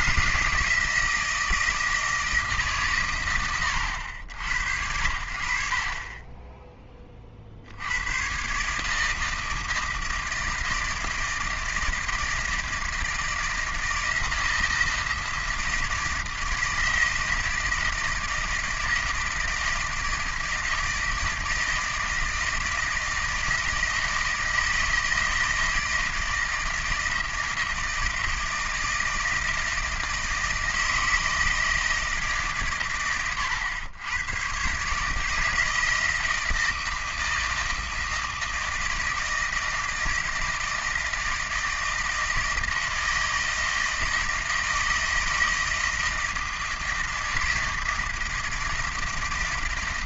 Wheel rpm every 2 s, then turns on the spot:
160, 150, 90, 20, 140, 160, 160, 160, 160, 160, 160, 160, 160, 160, 160, 160, 130, 130, 160, 160, 160, 160, 160, 160, 170.
none